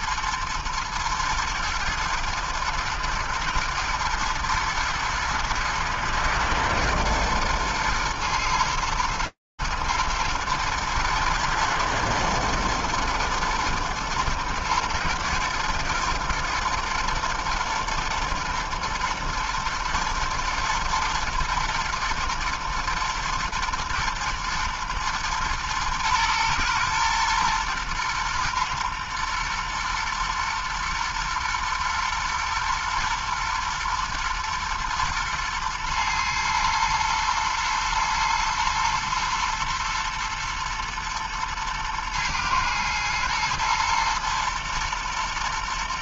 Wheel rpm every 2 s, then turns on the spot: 120, 110, 110, 110, 110, 120, 110, 120, 120, 110, 110, 110, 120, 120, 120, 120, 110, 120, 110, 120, 120, 110, 120.
none